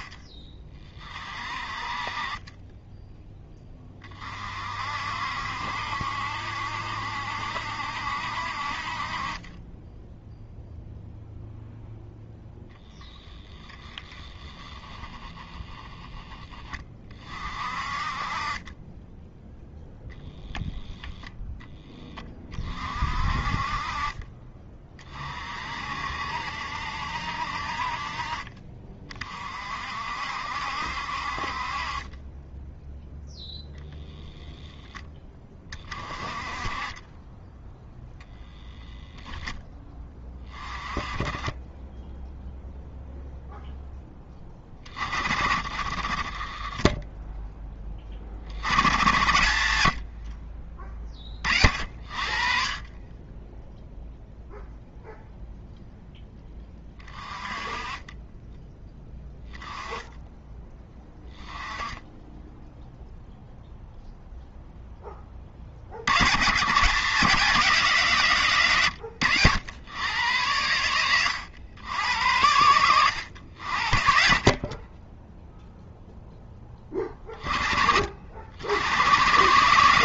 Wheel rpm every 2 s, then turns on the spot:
30, 10, 50, 70, 40, 0, 0, 10, 30, 20, 10, 30, 30, 70, 30, 60, 0, 0, 20, 0, 20, 0, 30, 20, 90, 20, 40, 0, 20, 10, 10, 0, 10, 150, 120, 100, 100, 30, 20, 90.
14-16